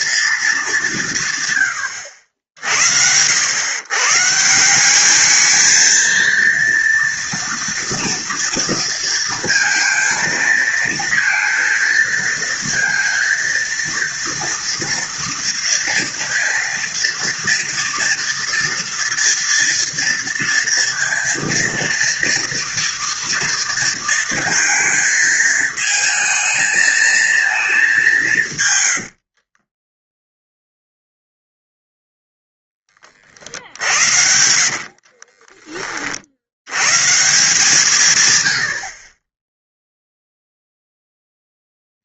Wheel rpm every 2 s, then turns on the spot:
180, 80, 200, 230, 230, 230, 230, 230, 240, 230, 230, 230, 220, 230, 90, 0, 20, 50, 130, 50, 10.
28-30 34-36